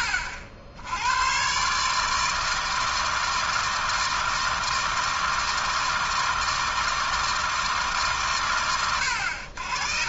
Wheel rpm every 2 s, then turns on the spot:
100, 160, 160, 160, 90.
none